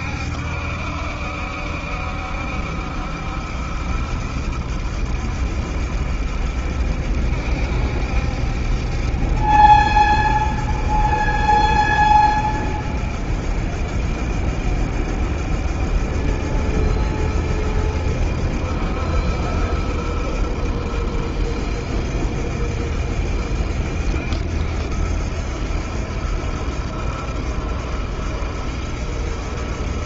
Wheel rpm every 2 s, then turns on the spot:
70, 70, 70, 70, 70, 70, 70, 70, 70, 70, 70, 70, 70, 70, 70.
none